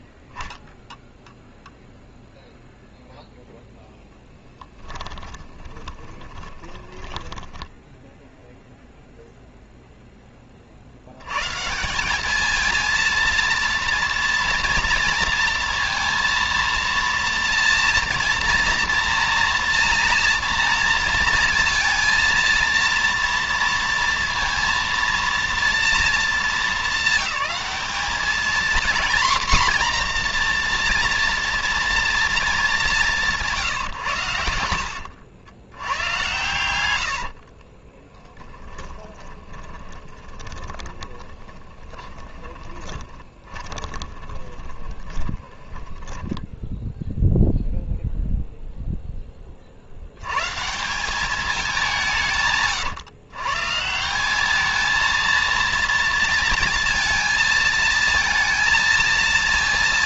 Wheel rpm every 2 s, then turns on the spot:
0, 0, 20, 10, 0, 190, 230, 230, 230, 230, 230, 230, 220, 200, 250, 230, 150, 100, 30, 20, 30, 20, 20, 0, 40, 200, 140, 230, 230, 230.
4-8 32-34 36-46